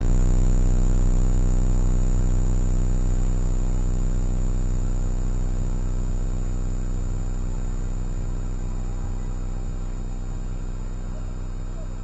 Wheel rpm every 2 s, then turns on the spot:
0, 0, 0, 0, 0, 0.
none